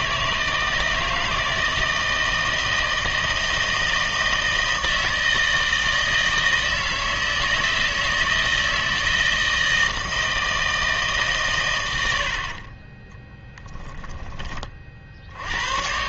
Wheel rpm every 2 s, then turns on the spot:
160, 160, 160, 160, 160, 160, 40, 40.
none